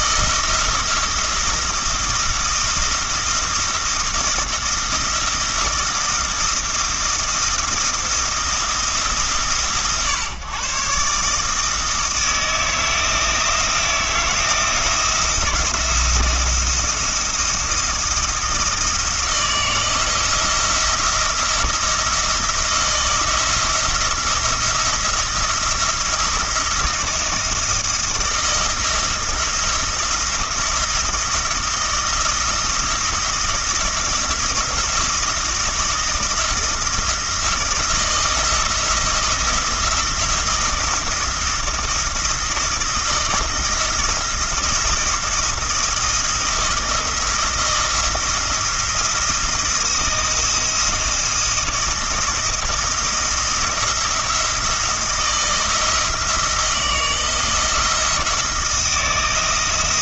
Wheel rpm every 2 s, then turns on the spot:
170, 170, 160, 170, 160, 130, 160, 170, 170, 160, 170, 170, 170, 170, 170, 170, 170, 170, 170, 170, 170, 160, 170, 170, 170, 160, 160, 170, 160, 170.
none